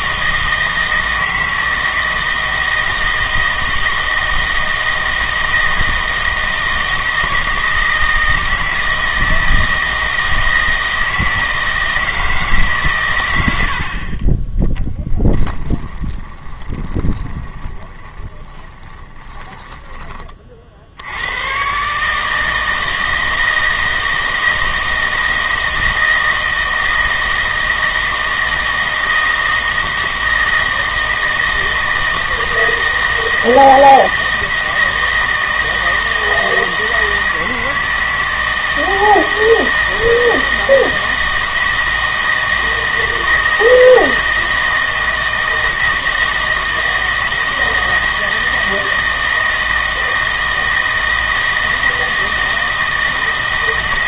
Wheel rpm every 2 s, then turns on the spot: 160, 160, 160, 160, 160, 160, 140, 10, 20, 20, 60, 160, 160, 160, 160, 160, 160, 160, 160, 160, 160, 160, 160, 160, 160, 160, 160.
14-20